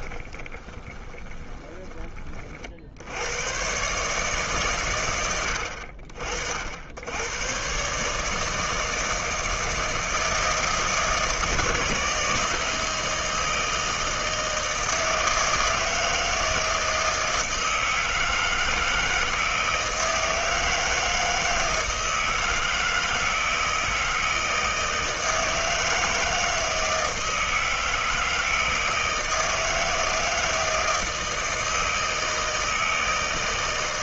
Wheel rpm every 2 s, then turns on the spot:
20, 60, 140, 60, 160, 160, 170, 160, 160, 160, 160, 160, 160, 160, 160, 160, 160.
0-2